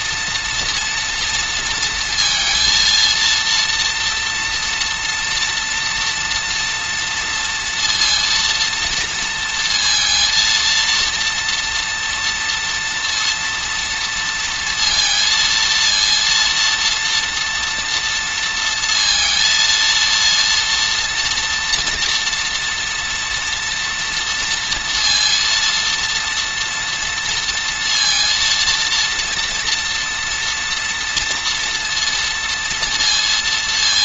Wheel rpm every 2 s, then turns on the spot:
230, 230, 230, 230, 230, 230, 230, 230, 230, 230, 230, 240, 230, 230, 230, 230, 230.
none